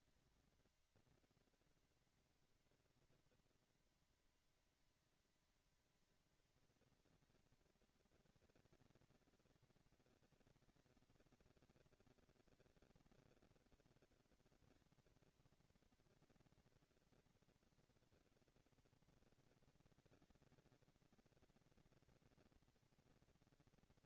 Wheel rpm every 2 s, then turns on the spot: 230, 240, 230, 230, 220, 230, 230, 230, 230, 230, 230, 230.
none